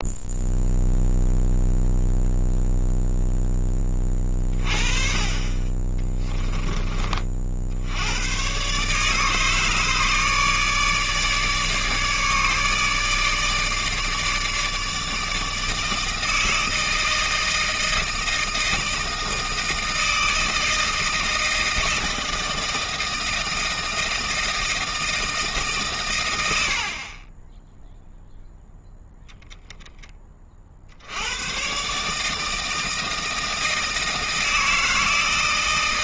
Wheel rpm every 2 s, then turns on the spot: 0, 0, 30, 30, 140, 150, 150, 160, 160, 160, 160, 160, 160, 60, 0, 60, 160, 160.
none